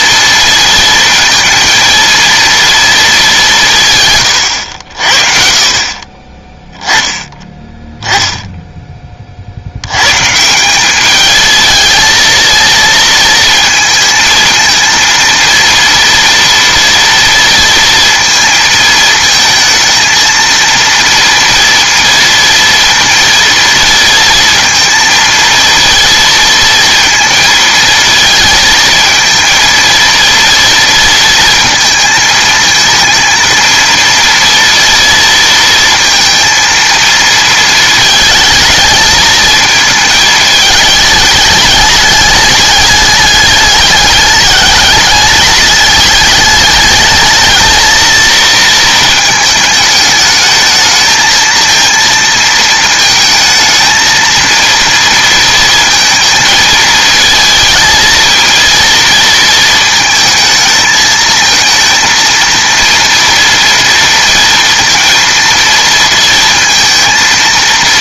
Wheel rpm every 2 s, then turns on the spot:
230, 230, 100, 10, 10, 190, 230, 220, 230, 230, 230, 230, 230, 230, 230, 230, 220, 230, 230, 220, 210, 210, 210, 210, 230, 220, 230, 230, 220, 230, 220, 230, 230, 230.
none